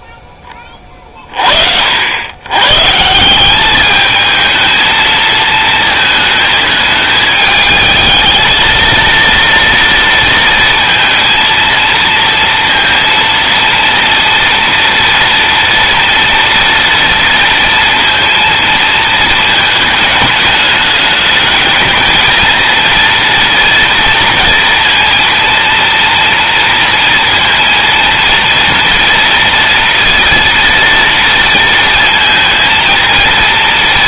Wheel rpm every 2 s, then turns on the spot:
30, 150, 220, 220, 230, 230, 230, 230, 230, 220, 210, 230, 230, 230, 230, 230, 230.
none